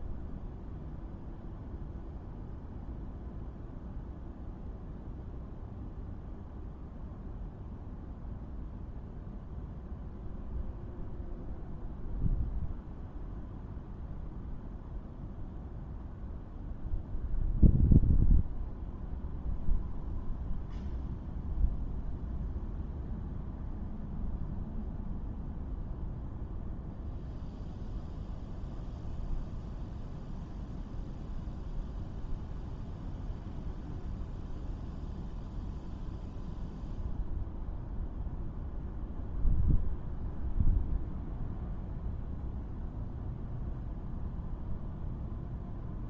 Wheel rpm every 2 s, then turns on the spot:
0, 0, 0, 0, 0, 0, 0, 0, 0, 0, 0, 0, 0, 0, 0, 0, 0, 0, 0, 0, 0, 0, 0.
none